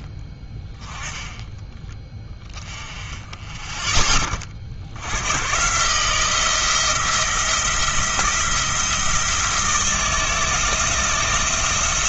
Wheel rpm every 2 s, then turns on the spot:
20, 30, 60, 160, 170, 170.
none